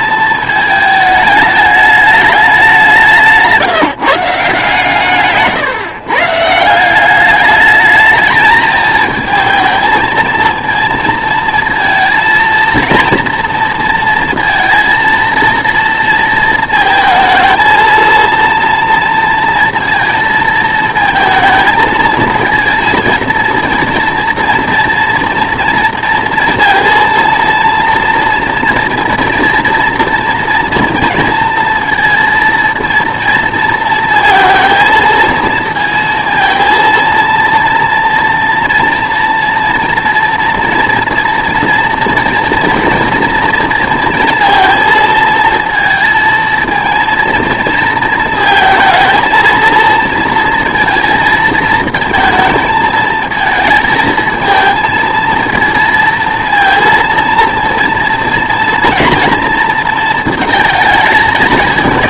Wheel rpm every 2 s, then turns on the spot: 220, 190, 150, 170, 220, 230, 230, 230, 220, 230, 220, 230, 230, 230, 230, 230, 230, 220, 230, 230, 240, 230, 230, 220, 230, 230, 220, 220, 230, 230, 220.
none